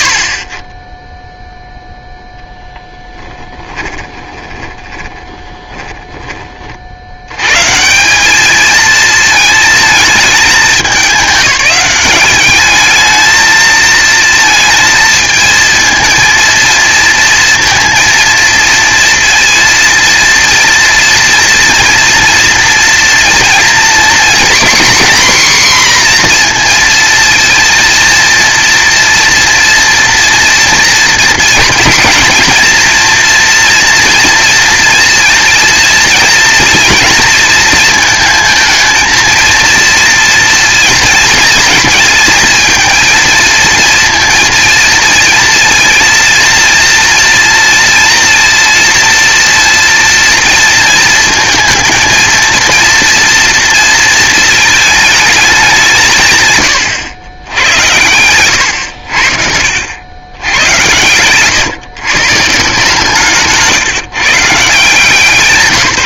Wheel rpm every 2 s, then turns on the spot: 50, 10, 20, 40, 220, 210, 210, 220, 230, 230, 230, 230, 250, 230, 230, 230, 230, 230, 230, 220, 230, 230, 230, 230, 230, 230, 230, 220, 120, 100, 100, 150, 160.
4-6